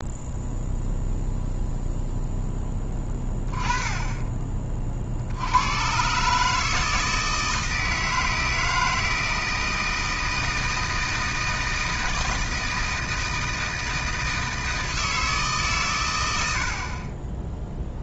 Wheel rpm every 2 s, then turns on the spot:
0, 10, 30, 160, 160, 160, 160, 160, 70.
none